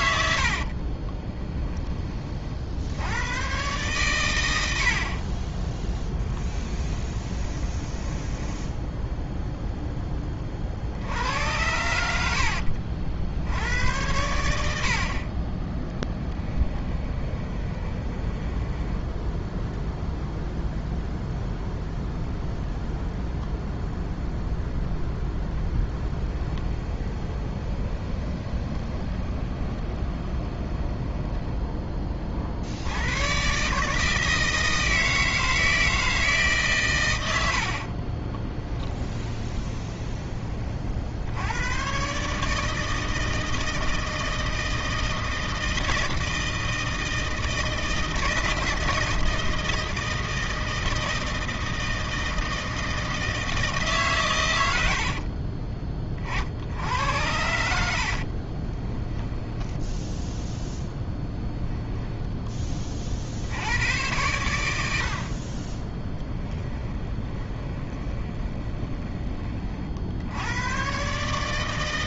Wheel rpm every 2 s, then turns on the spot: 30, 70, 60, 10, 10, 60, 60, 60, 20, 10, 0, 0, 0, 20, 20, 10, 90, 160, 120, 20, 50, 160, 160, 160, 160, 160, 160, 70, 90, 20, 0, 30, 80, 30, 20, 130.
0-2 6-10 16-20 26-32 38-40 54-56 58-60 66-70